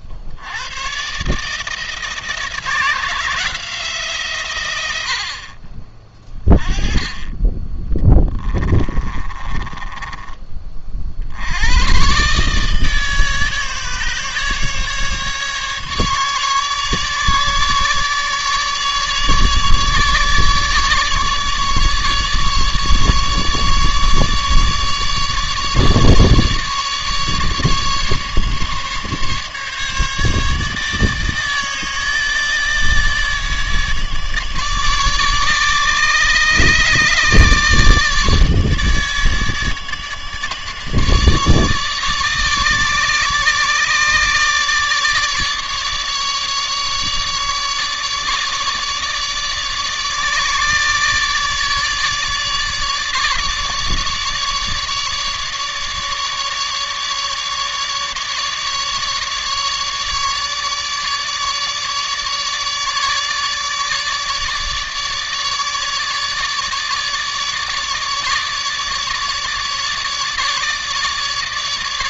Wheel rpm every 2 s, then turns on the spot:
90, 170, 110, 20, 20, 40, 150, 150, 150, 150, 150, 150, 150, 150, 140, 150, 150, 150, 150, 150, 150, 150, 150, 150, 150, 150, 150, 150, 150, 150, 150, 150, 150, 150, 150, 150.
8-10